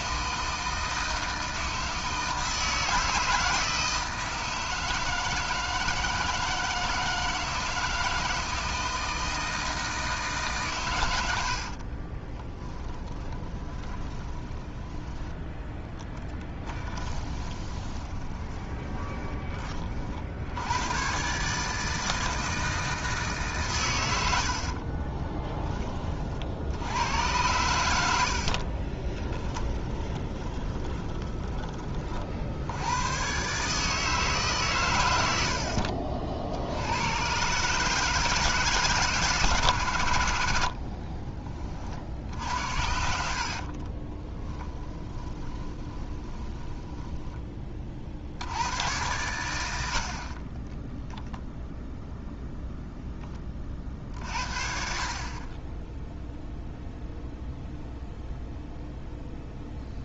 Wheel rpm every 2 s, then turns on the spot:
160, 160, 160, 160, 160, 120, 10, 10, 20, 20, 100, 160, 50, 70, 30, 20, 90, 120, 90, 150, 50, 70, 10, 10, 110, 10, 0, 50, 0, 0.
12-20 24-26 28-32 40-46 50-52